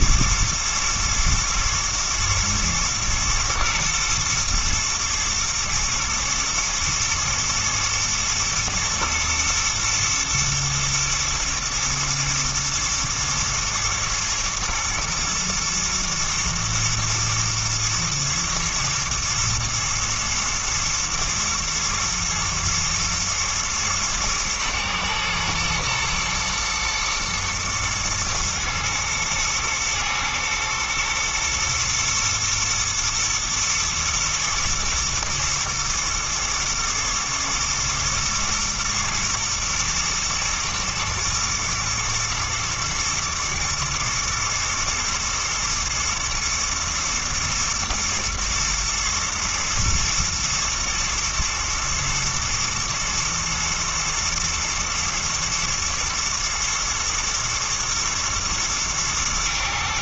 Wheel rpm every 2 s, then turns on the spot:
110, 110, 110, 120, 110, 120, 110, 110, 120, 110, 110, 120, 110, 110, 120, 110, 120, 110, 110, 120, 110, 110, 110, 120, 110, 110, 110, 110, 120, 110.
none